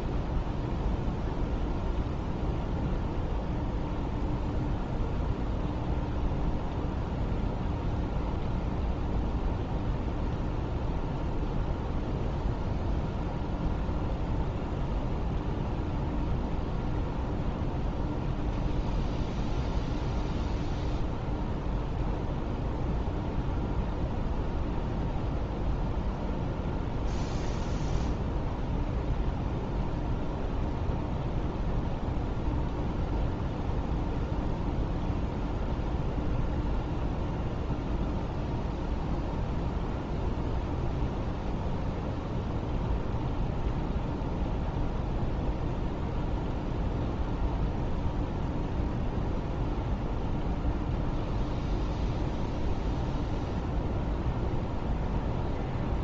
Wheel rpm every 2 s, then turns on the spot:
0, 0, 0, 0, 0, 0, 0, 0, 0, 0, 0, 0, 0, 0, 0, 0, 0, 0, 0, 0, 0, 0, 0, 0, 0, 0, 0, 0.
none